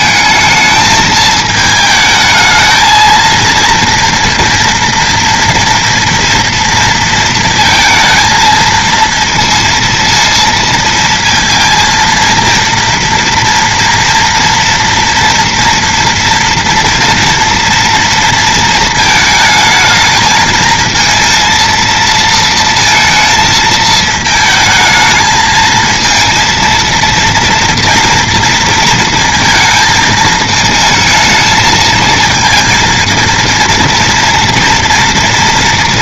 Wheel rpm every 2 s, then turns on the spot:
220, 220, 230, 230, 230, 230, 230, 230, 230, 230, 220, 230, 220, 230, 230, 220, 230, 230.
none